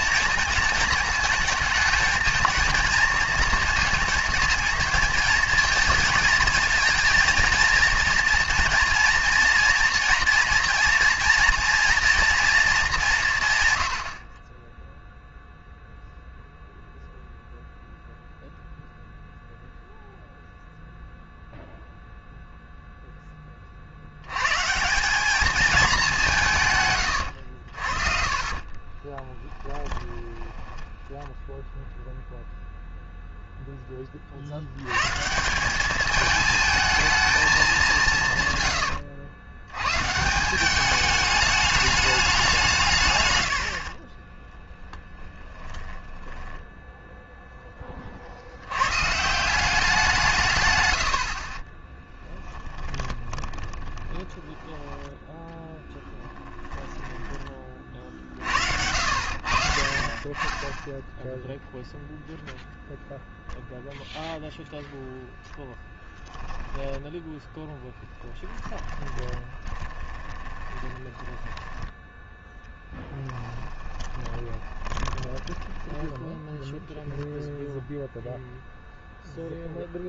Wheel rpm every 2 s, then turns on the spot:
220, 220, 220, 230, 230, 240, 210, 10, 0, 0, 0, 0, 150, 150, 20, 10, 0, 90, 220, 120, 190, 170, 20, 10, 100, 120, 20, 20, 10, 60, 20, 0, 0, 10, 10, 30, 10, 20, 0, 0.
28-32 38-40 44-48 52-58 66-72 74-76